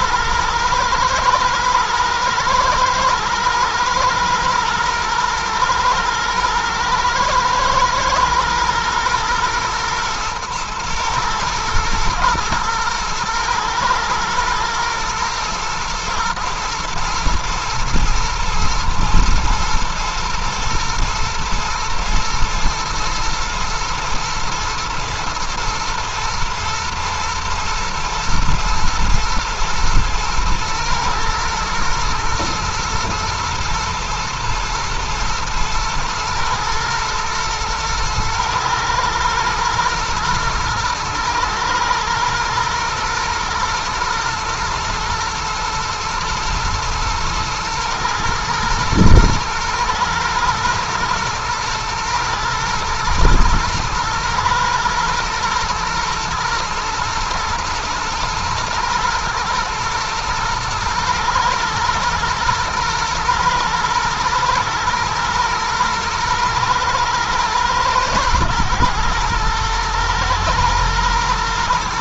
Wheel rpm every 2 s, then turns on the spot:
110, 110, 110, 110, 110, 110, 110, 120, 110, 110, 110, 120, 110, 120, 110, 110, 120, 110, 110, 120, 110, 120, 110, 110, 110, 110, 110, 110, 120, 110, 110, 110, 110, 110, 110, 120.
none